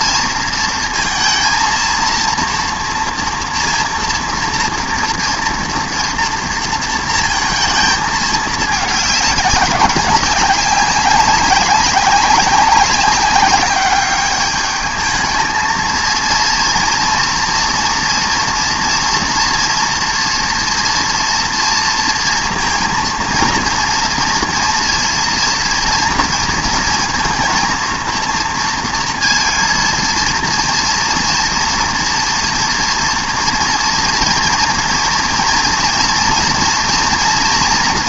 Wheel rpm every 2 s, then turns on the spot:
230, 230, 230, 230, 210, 190, 190, 210, 230, 230, 230, 230, 230, 230, 230, 230, 230, 230, 230.
none